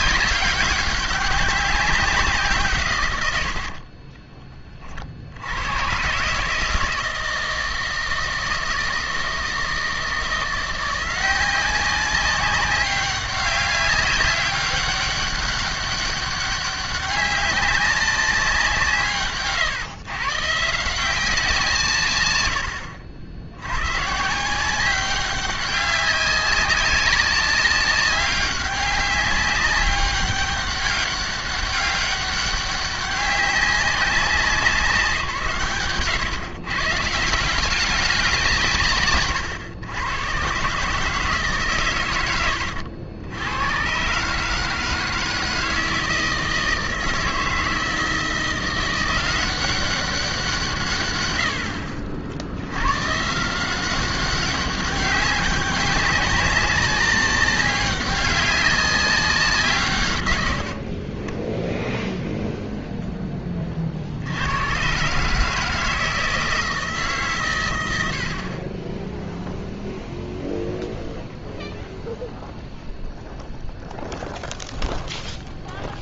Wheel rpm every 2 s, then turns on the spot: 190, 120, 50, 160, 160, 170, 200, 200, 200, 160, 170, 70, 190, 190, 190, 200, 200, 180, 140, 140, 150, 90, 160, 160, 170, 130, 100, 190, 200, 200, 50, 10, 130, 150, 10, 0, 0, 0.
none